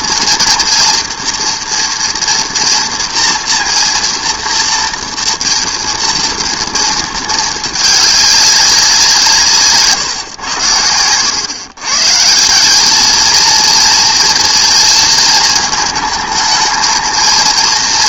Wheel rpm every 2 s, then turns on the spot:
230, 230, 240, 230, 200, 110, 180, 230, 220.
none